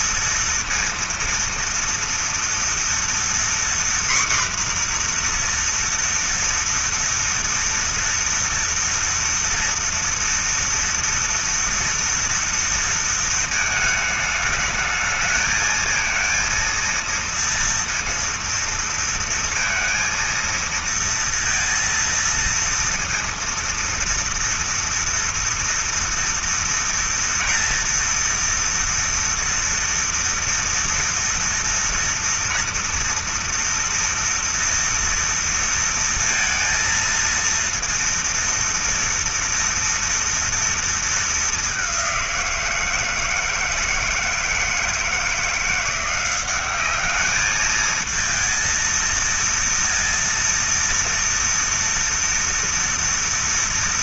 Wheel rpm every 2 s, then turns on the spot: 230, 230, 250, 240, 230, 230, 230, 210, 230, 230, 230, 230, 230, 230, 230, 230, 230, 230, 230, 230, 230, 180, 160, 180, 230, 230, 230.
none